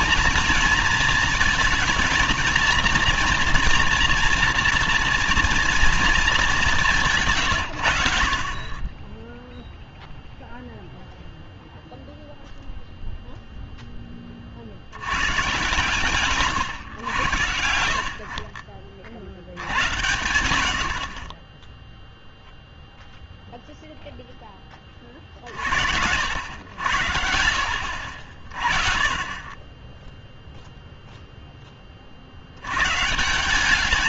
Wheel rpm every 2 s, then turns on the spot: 230, 230, 240, 200, 70, 0, 0, 30, 130, 60, 80, 0, 10, 70, 50, 0, 80.
none